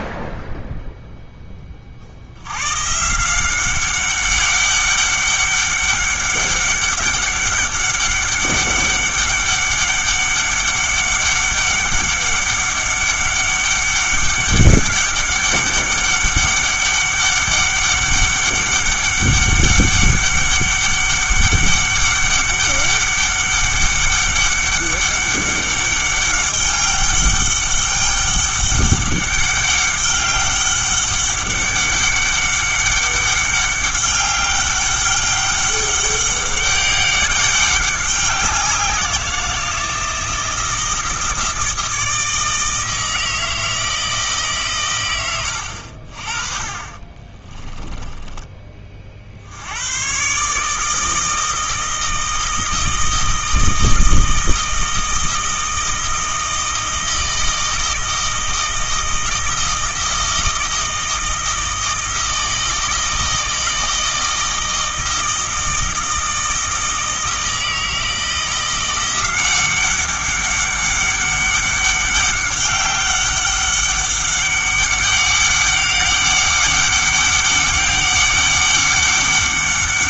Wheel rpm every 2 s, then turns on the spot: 0, 120, 200, 200, 200, 200, 200, 200, 200, 200, 200, 200, 200, 200, 200, 200, 200, 200, 200, 180, 160, 160, 130, 40, 20, 150, 160, 160, 160, 160, 160, 160, 160, 160, 170, 200, 200, 200, 200, 200.
46-48